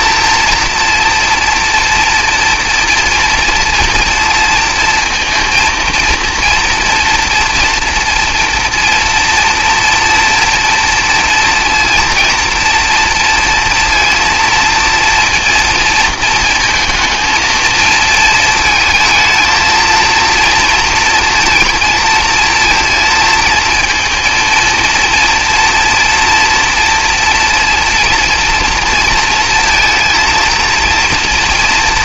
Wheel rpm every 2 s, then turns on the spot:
230, 230, 220, 230, 230, 230, 230, 230, 220, 220, 230, 230, 230, 230, 230, 230.
none